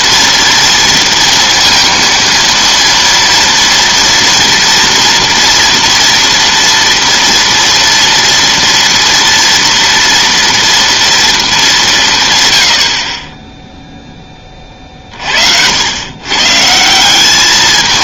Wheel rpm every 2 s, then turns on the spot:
230, 230, 240, 230, 230, 230, 90, 30, 150.
none